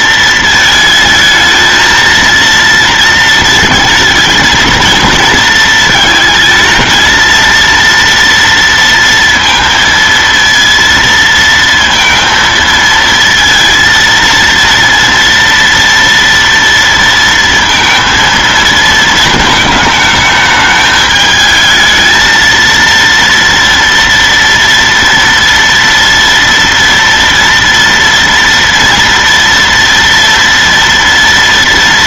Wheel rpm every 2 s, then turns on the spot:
230, 230, 230, 220, 230, 230, 230, 230, 230, 230, 220, 220, 230, 230, 230, 230.
none